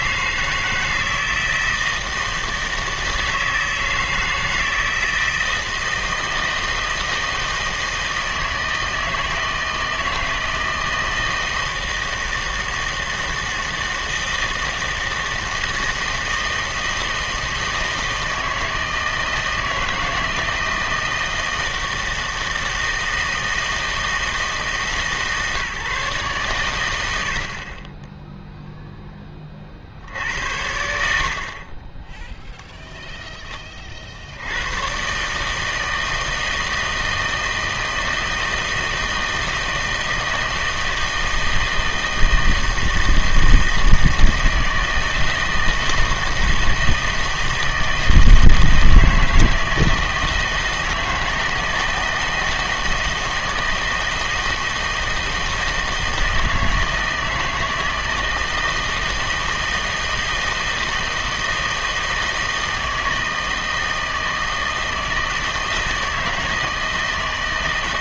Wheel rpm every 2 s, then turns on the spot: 160, 160, 160, 160, 160, 160, 160, 160, 160, 160, 160, 160, 160, 130, 0, 70, 0, 100, 160, 160, 160, 160, 160, 160, 160, 160, 160, 160, 160, 160, 160, 160, 160, 160.
none